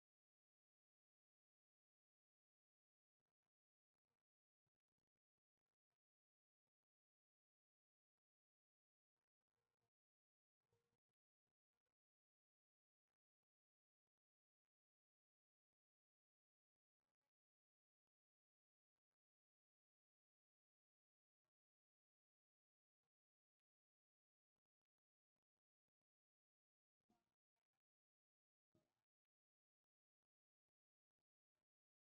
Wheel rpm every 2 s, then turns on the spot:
0, 0, 0, 0, 0, 0, 0, 0, 0, 0, 0, 0, 0, 0, 0, 0.
none